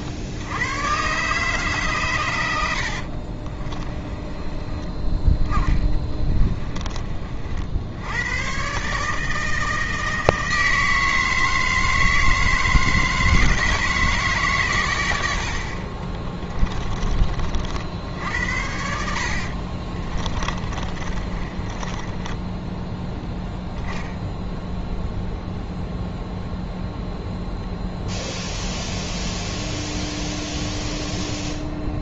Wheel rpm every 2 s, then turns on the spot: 110, 80, 30, 30, 140, 160, 160, 130, 20, 70, 30, 10, 0, 0, 0, 0.
2-6 20-24